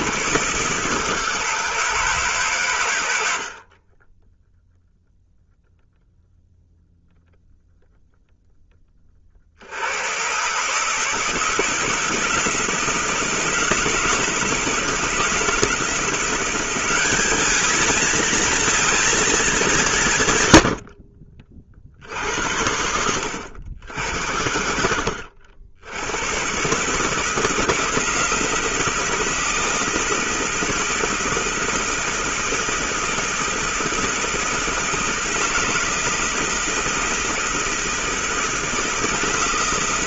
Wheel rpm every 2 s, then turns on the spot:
140, 130, 0, 0, 10, 140, 160, 160, 180, 220, 120, 70, 60, 120, 160, 160, 170, 160, 160, 160.
none